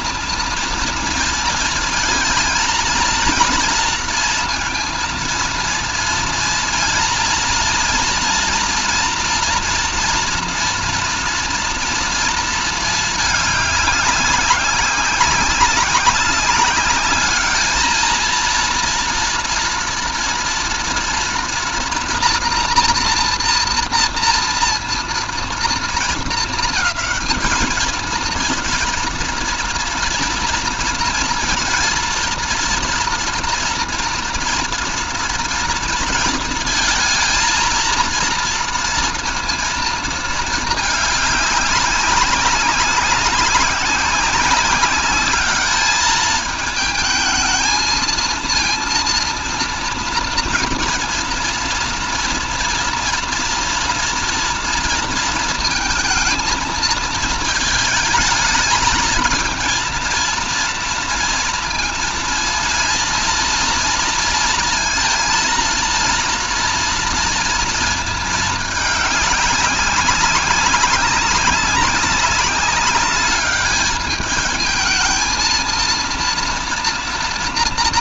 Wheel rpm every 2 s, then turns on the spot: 230, 230, 230, 230, 230, 230, 220, 190, 200, 230, 230, 230, 230, 220, 230, 230, 230, 240, 230, 230, 210, 190, 190, 220, 230, 230, 230, 230, 220, 220, 230, 230, 230, 230, 210, 190, 200, 220, 230.
none